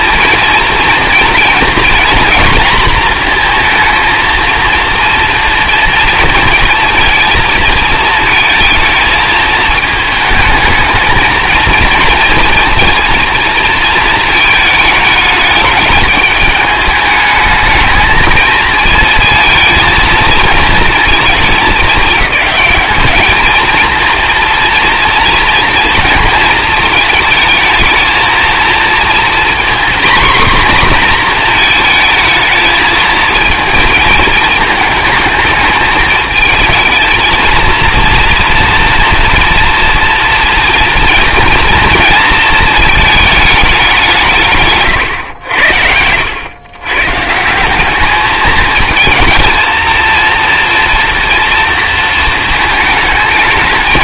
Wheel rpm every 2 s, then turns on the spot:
230, 220, 230, 230, 230, 220, 230, 220, 210, 220, 230, 210, 230, 230, 230, 240, 220, 220, 220, 230, 230, 230, 150, 110, 220, 230, 220.
none